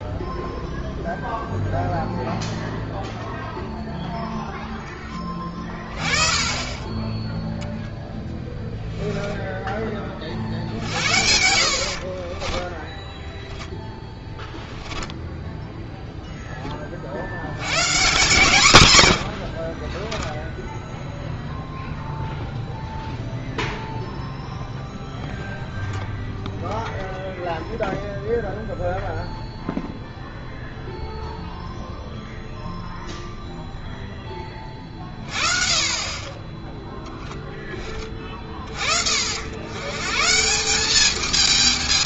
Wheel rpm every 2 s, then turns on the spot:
0, 0, 0, 20, 10, 50, 10, 10, 10, 160, 0, 0, 0, 0, 0, 0, 0, 20, 10, 40, 180.
8-10 12-16